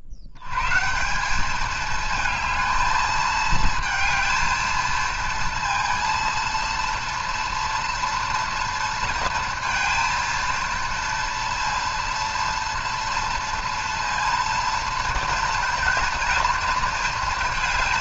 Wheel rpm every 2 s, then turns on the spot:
80, 220, 220, 230, 230, 230, 240, 230, 230.
none